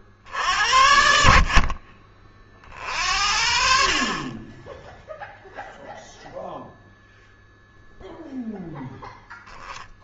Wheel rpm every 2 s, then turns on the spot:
60, 50, 20, 0, 0.
none